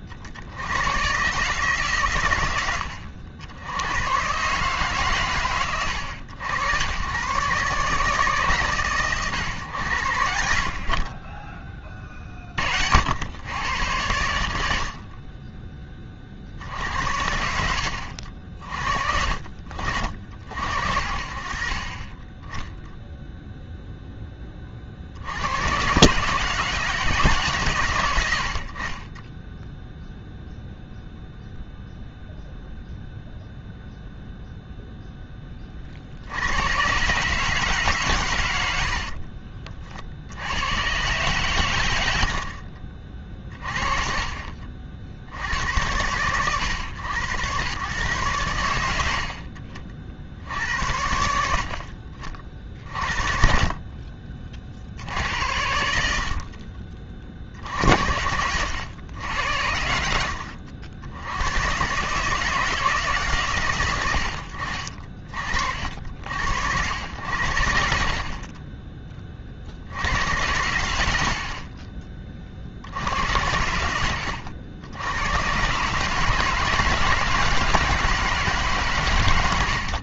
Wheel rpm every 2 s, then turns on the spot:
50, 110, 130, 90, 140, 60, 70, 70, 80, 50, 50, 0, 90, 140, 10, 0, 0, 10, 140, 50, 120, 40, 80, 100, 70, 70, 40, 70, 30, 100, 80, 160, 50, 80, 20, 80, 60, 90, 160, 130.
38-40